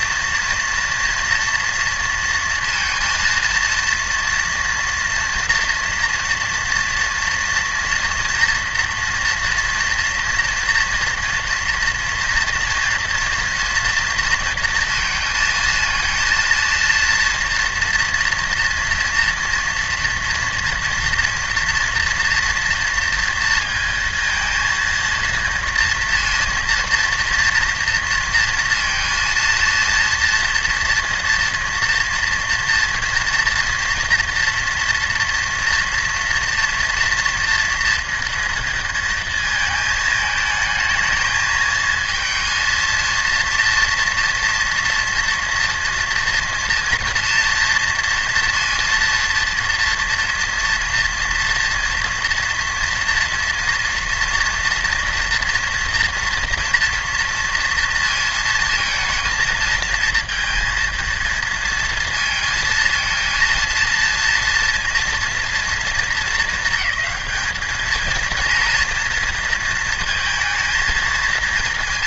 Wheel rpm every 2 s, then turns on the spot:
230, 230, 230, 230, 230, 230, 230, 230, 230, 230, 230, 230, 220, 230, 230, 240, 230, 230, 230, 230, 220, 230, 240, 240, 230, 230, 230, 240, 230, 230, 230, 230, 230, 220, 230, 230.
none